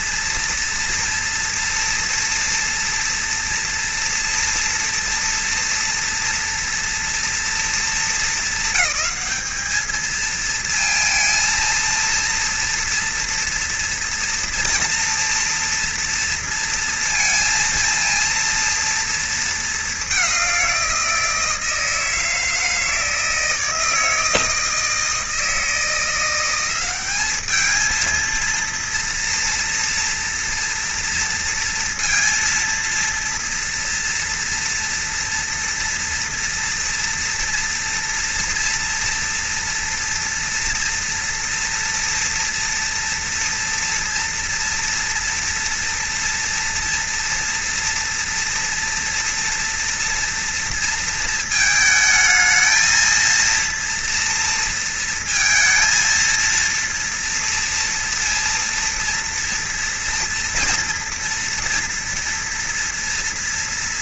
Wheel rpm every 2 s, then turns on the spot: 230, 230, 230, 230, 220, 230, 230, 230, 230, 230, 190, 160, 160, 180, 230, 230, 230, 230, 230, 230, 240, 230, 230, 230, 230, 230, 220, 230, 230, 230, 230, 230.
none